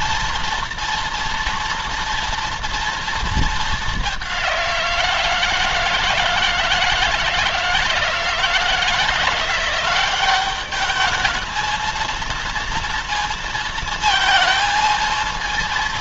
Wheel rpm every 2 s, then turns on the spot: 230, 230, 170, 160, 160, 200, 230, 220.
none